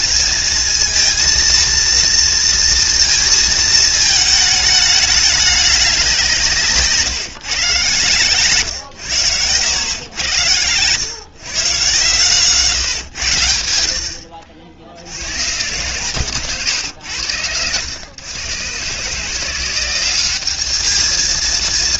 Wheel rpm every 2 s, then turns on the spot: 230, 230, 220, 170, 120, 110, 130, 70, 130, 120, 200.
8-10